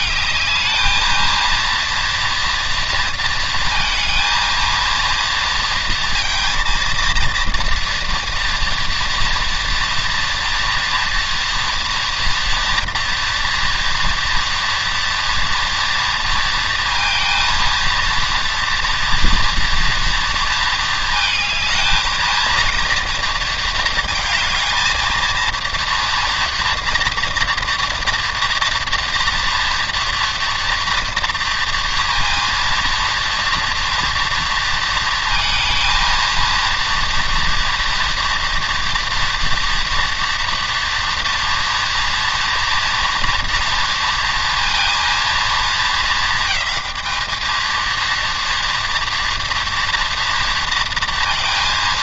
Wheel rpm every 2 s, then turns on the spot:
220, 230, 230, 230, 230, 240, 230, 230, 230, 230, 230, 230, 220, 230, 240, 230, 230, 230, 230, 240, 230, 230, 230, 220, 230, 230.
none